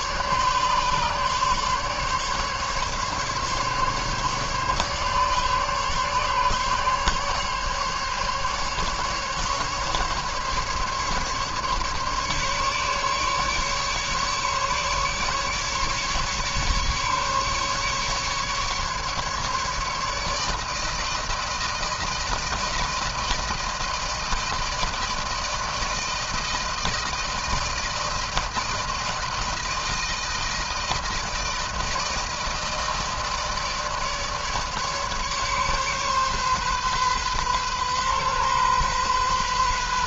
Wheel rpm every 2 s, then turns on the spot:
140, 140, 140, 140, 140, 140, 140, 140, 150, 140, 160, 160, 160, 160, 160, 160, 160, 150, 140, 130.
none